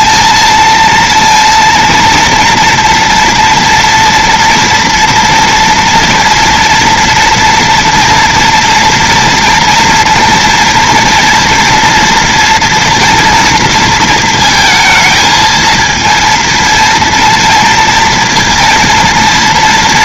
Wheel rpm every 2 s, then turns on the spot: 220, 230, 230, 230, 230, 230, 230, 230, 230, 230.
none